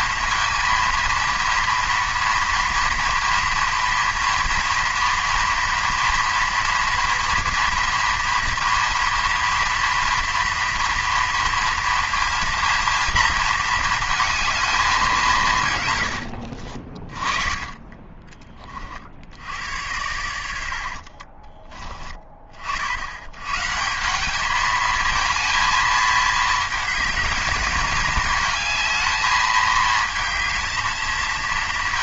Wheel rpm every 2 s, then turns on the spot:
230, 230, 230, 230, 230, 230, 230, 220, 70, 40, 70, 60, 210, 220, 220, 220.
16-18 20-22